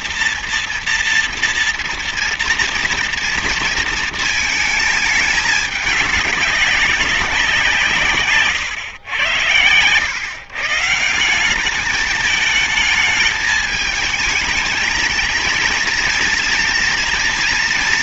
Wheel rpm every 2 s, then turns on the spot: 240, 240, 220, 200, 110, 150, 220, 220, 230.
none